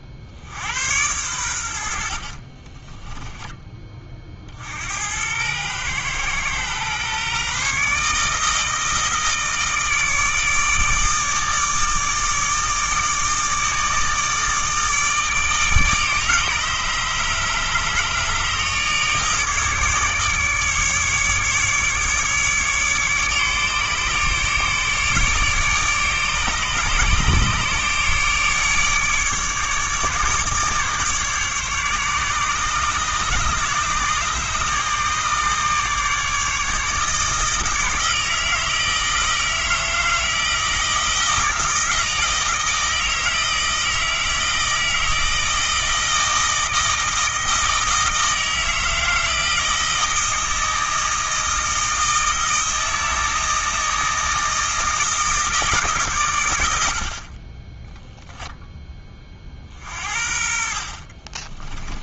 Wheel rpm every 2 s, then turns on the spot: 90, 40, 60, 120, 160, 150, 150, 150, 150, 150, 150, 150, 150, 150, 150, 150, 150, 150, 150, 160, 160, 160, 160, 160, 160, 160, 160, 160, 80, 10, 40.
2-4 60-62